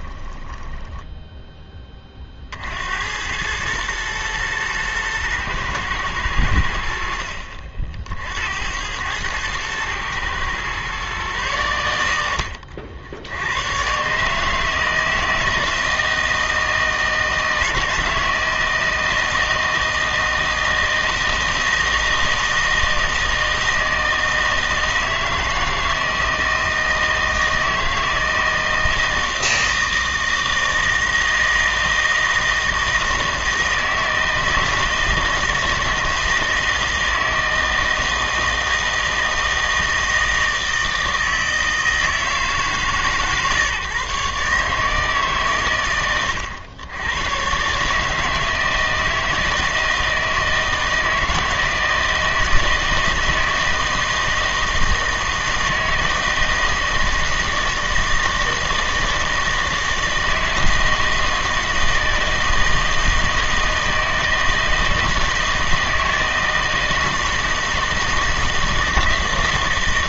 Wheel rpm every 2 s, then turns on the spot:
10, 60, 110, 80, 80, 120, 70, 150, 160, 160, 160, 160, 160, 160, 160, 160, 160, 160, 160, 160, 160, 150, 150, 100, 160, 160, 160, 160, 160, 160, 160, 160, 160, 160, 160.
0-2